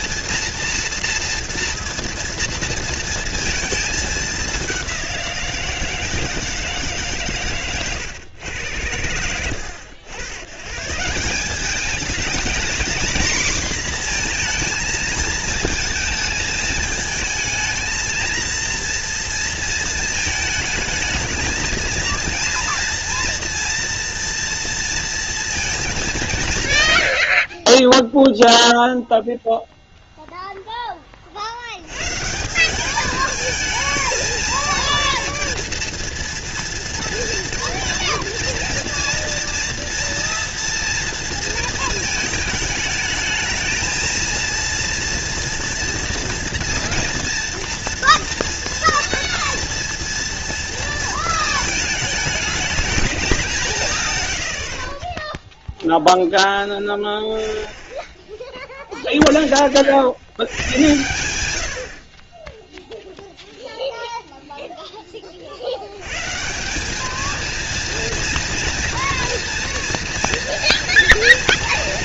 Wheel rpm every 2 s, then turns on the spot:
230, 230, 190, 150, 100, 140, 230, 230, 220, 230, 220, 230, 230, 110, 0, 20, 210, 230, 230, 230, 230, 220, 230, 230, 240, 230, 220, 40, 0, 0, 100, 0, 10, 200, 240, 230.
none